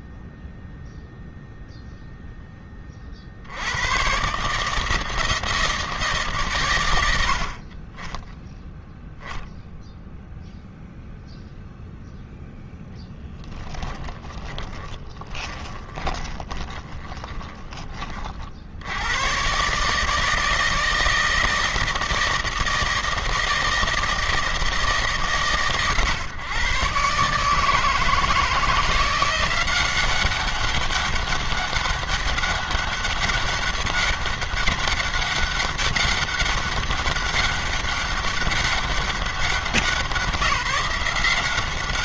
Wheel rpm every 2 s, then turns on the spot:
0, 30, 160, 80, 0, 0, 10, 30, 20, 80, 160, 160, 150, 130, 170, 200, 200, 200, 200, 190, 170.
14-18